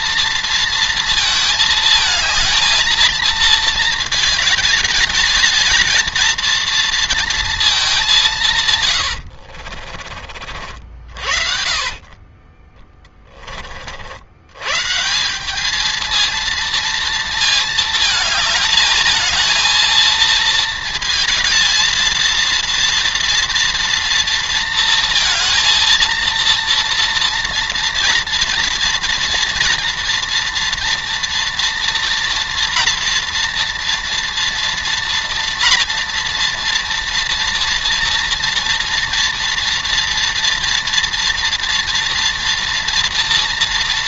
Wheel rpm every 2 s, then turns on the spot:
230, 220, 220, 230, 140, 50, 30, 130, 230, 220, 230, 230, 230, 230, 230, 230, 230, 230, 230, 230, 230, 230.
8-10